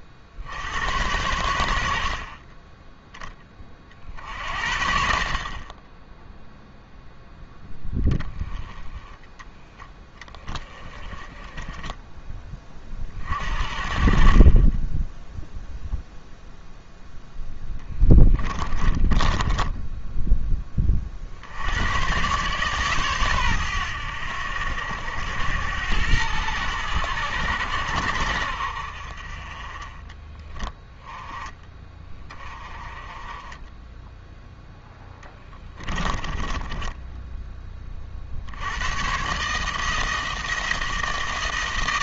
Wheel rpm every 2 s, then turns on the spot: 80, 20, 60, 0, 10, 20, 20, 20, 0, 20, 20, 130, 80, 100, 60, 10, 20, 0, 20, 90, 160.
8-10 18-20 36-38